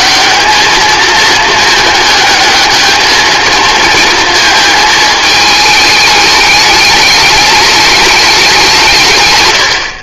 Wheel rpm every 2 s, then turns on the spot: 210, 220, 220, 210, 200.
none